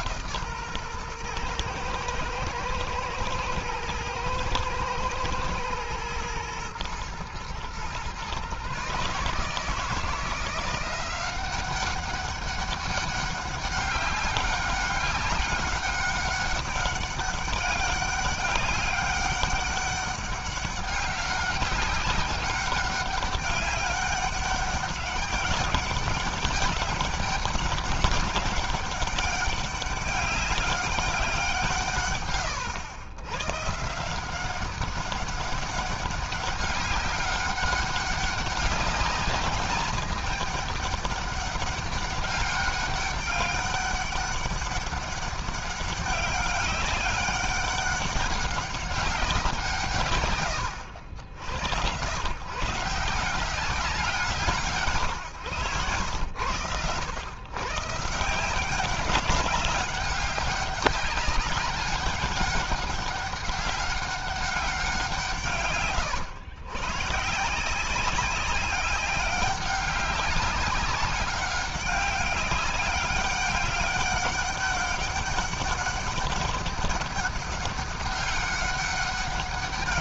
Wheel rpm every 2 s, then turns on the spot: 160, 110, 110, 120, 130, 160, 190, 200, 200, 200, 190, 200, 200, 200, 200, 200, 130, 170, 200, 200, 210, 200, 200, 190, 200, 120, 130, 160, 110, 160, 200, 200, 200, 110, 190, 190, 200, 200, 200, 200.
none